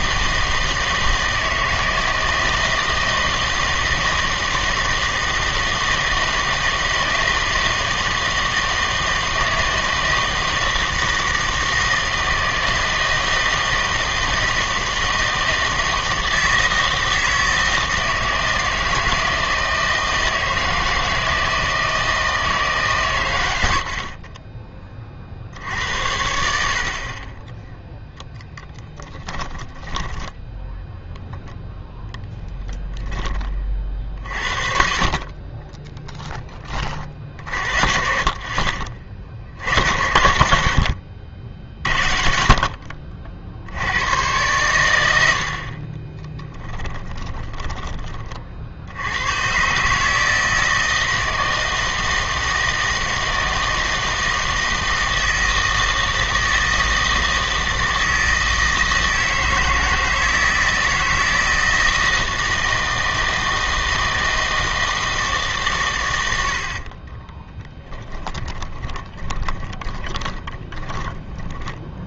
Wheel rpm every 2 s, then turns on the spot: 160, 160, 160, 160, 160, 160, 160, 160, 160, 160, 160, 150, 30, 70, 10, 0, 10, 50, 20, 40, 70, 60, 100, 10, 60, 160, 160, 160, 160, 160, 160, 160, 160, 80, 20, 20.
28-30 46-48 66-72